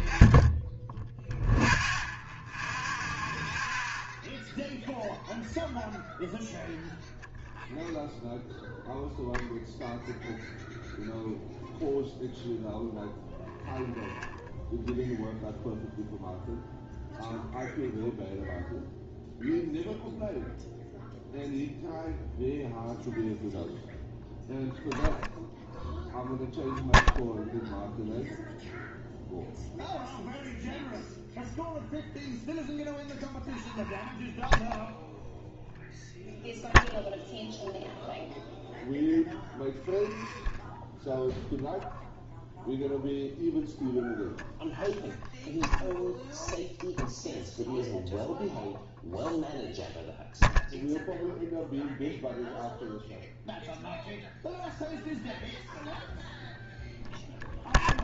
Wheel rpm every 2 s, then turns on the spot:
20, 0, 0, 0, 0, 0, 0, 0, 0, 0, 0, 0, 0, 0, 0, 0, 0, 0, 0, 0, 0, 0, 0, 0, 0, 0, 0, 0, 0.
none